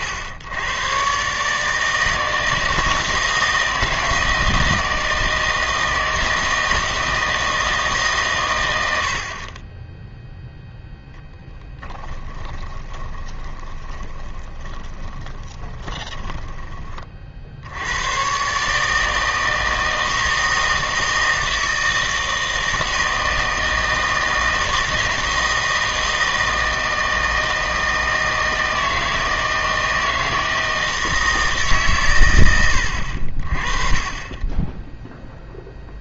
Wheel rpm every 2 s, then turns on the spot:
110, 160, 160, 160, 90, 0, 20, 20, 20, 150, 160, 160, 160, 160, 160, 160, 90, 10.
12-16